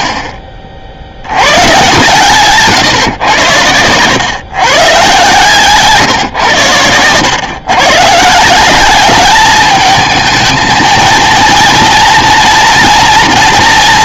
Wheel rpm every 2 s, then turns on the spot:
40, 130, 120, 110, 190, 220, 230.
none